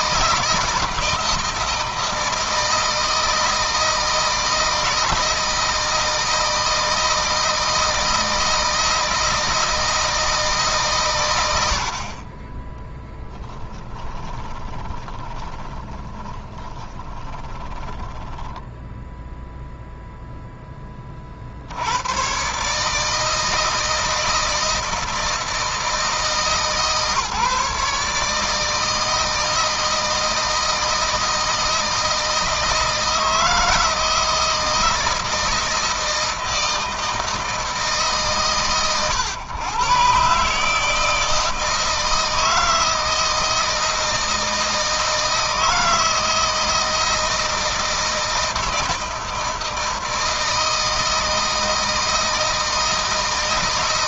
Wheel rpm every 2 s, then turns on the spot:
160, 160, 160, 160, 160, 140, 10, 20, 20, 10, 20, 150, 160, 160, 160, 160, 160, 160, 160, 130, 150, 160, 160, 160, 160, 160, 160.
12-20